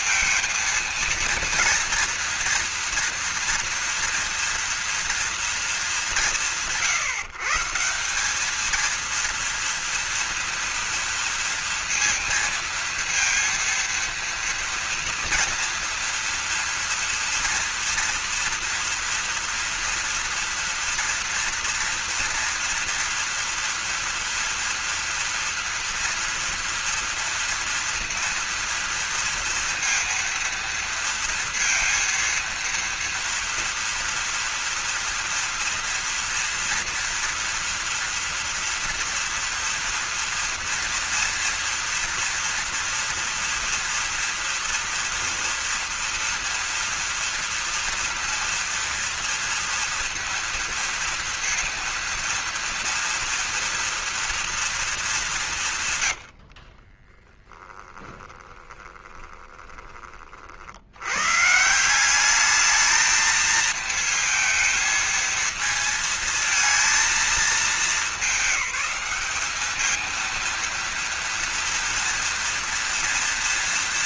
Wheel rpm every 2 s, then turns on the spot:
230, 230, 230, 150, 230, 230, 230, 230, 230, 230, 230, 230, 230, 230, 230, 230, 230, 230, 230, 230, 230, 230, 240, 230, 230, 230, 230, 220, 20, 20, 90, 220, 230, 230, 200, 230, 240.
56-60